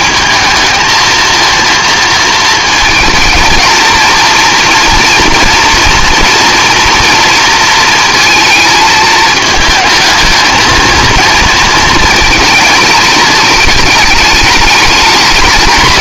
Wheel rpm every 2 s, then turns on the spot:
220, 230, 230, 230, 220, 220, 220, 210.
none